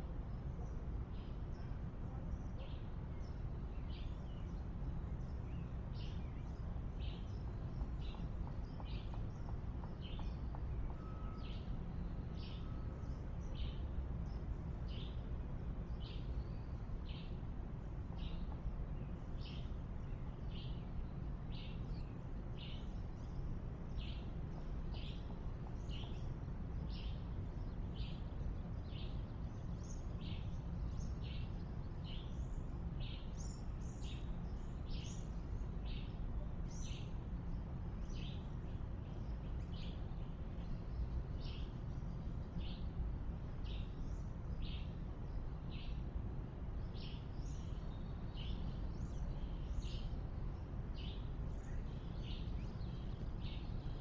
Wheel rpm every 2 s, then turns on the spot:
0, 0, 0, 0, 0, 0, 0, 0, 0, 0, 0, 0, 0, 0, 0, 0, 0, 0, 0, 0, 0, 0, 0, 0, 0, 0, 0.
none